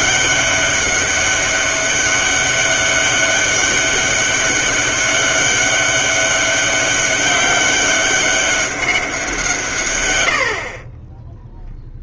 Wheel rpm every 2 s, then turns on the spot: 200, 200, 200, 200, 200, 50.
none